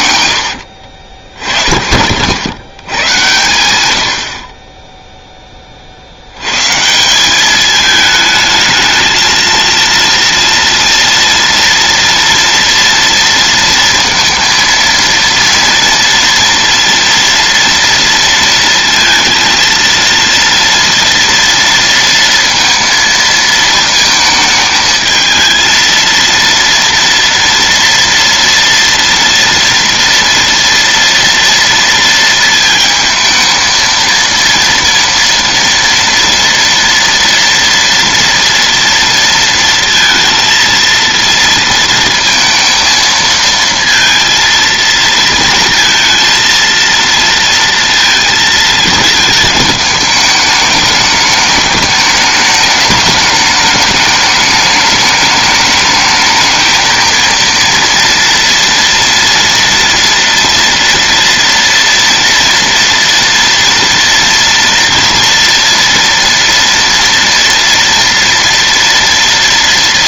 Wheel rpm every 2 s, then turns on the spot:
60, 110, 20, 150, 220, 230, 230, 230, 230, 230, 230, 230, 220, 230, 230, 230, 220, 230, 230, 230, 230, 230, 230, 230, 220, 210, 210, 210, 220, 230, 230, 230, 230, 230, 230.
none